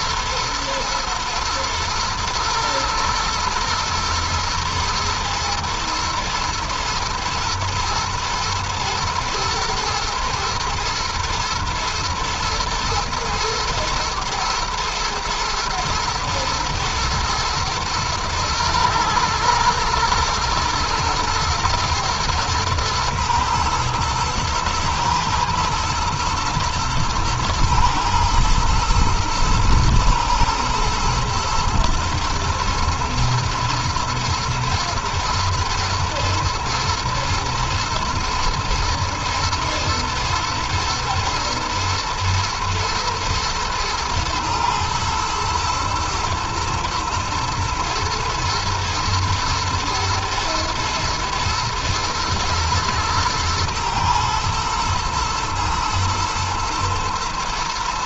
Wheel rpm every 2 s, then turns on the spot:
120, 110, 120, 120, 120, 120, 110, 110, 110, 110, 110, 110, 110, 110, 110, 110, 110, 120, 120, 110, 120, 120, 110, 110, 110, 120, 110, 120, 120.
none